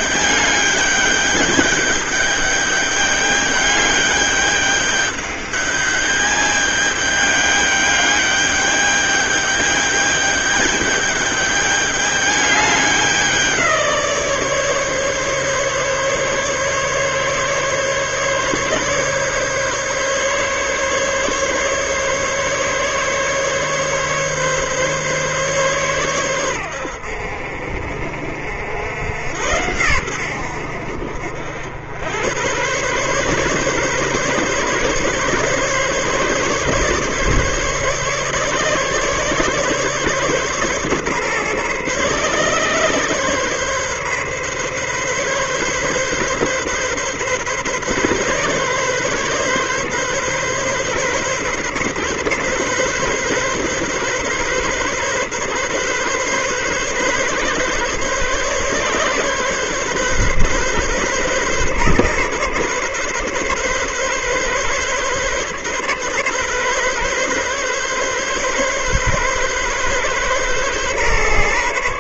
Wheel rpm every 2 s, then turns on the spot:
210, 210, 210, 210, 210, 210, 200, 150, 140, 140, 150, 140, 140, 100, 80, 80, 110, 140, 140, 140, 140, 140, 140, 140, 140, 140, 140, 140, 140, 130, 140, 140, 140, 130, 140, 130.
none